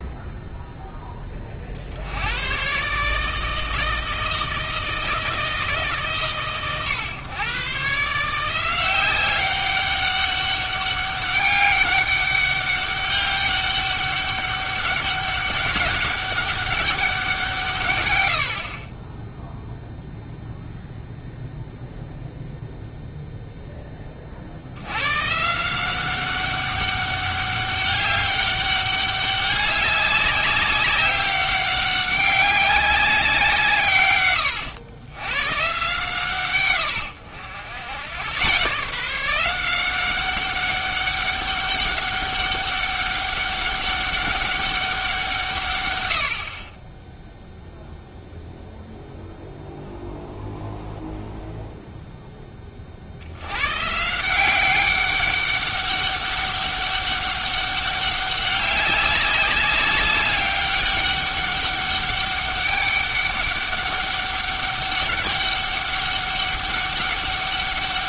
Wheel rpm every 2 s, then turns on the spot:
0, 130, 160, 130, 180, 200, 200, 200, 200, 60, 0, 0, 80, 200, 200, 200, 190, 100, 120, 150, 200, 200, 190, 30, 0, 0, 30, 190, 200, 200, 200, 200, 200, 200.
none